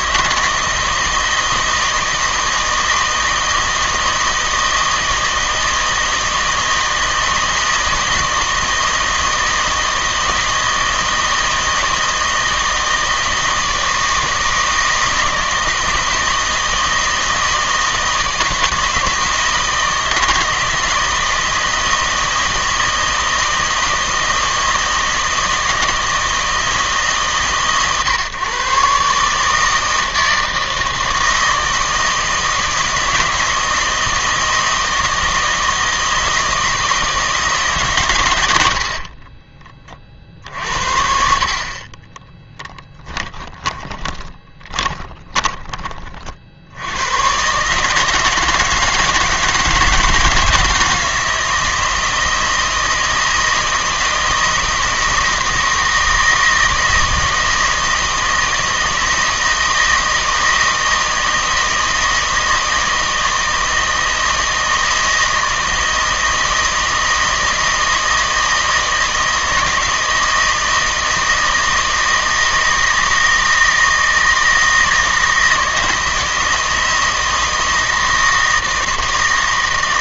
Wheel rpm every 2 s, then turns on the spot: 160, 160, 160, 160, 160, 160, 160, 160, 160, 160, 160, 160, 160, 160, 130, 160, 160, 160, 160, 70, 60, 20, 20, 60, 160, 170, 160, 160, 160, 160, 160, 160, 160, 160, 160, 160, 160, 160, 160, 160.
42-46